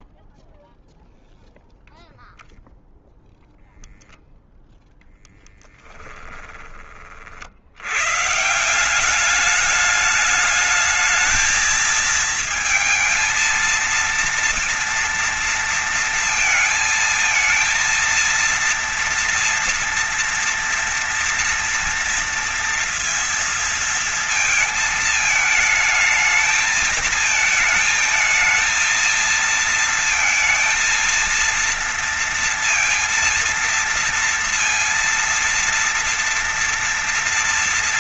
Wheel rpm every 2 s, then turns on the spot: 0, 0, 0, 40, 180, 220, 230, 230, 230, 230, 230, 230, 220, 220, 220, 230, 230, 230, 230.
none